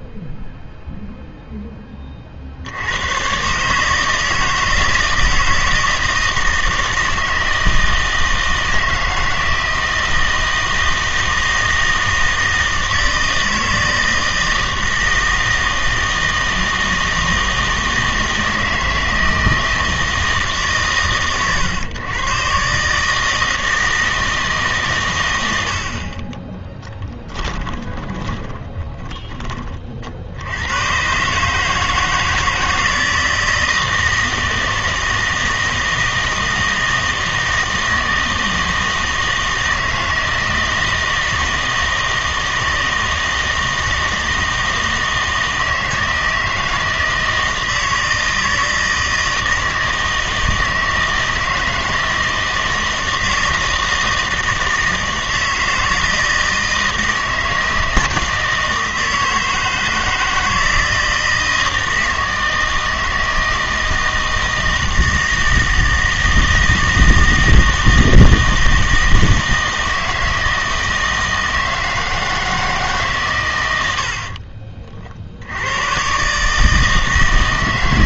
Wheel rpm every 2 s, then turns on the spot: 0, 80, 160, 160, 160, 160, 160, 160, 160, 160, 140, 140, 140, 10, 10, 110, 160, 160, 160, 160, 160, 160, 160, 160, 160, 160, 160, 160, 160, 160, 160, 160, 160, 160, 160, 160, 160, 30, 150.
26-30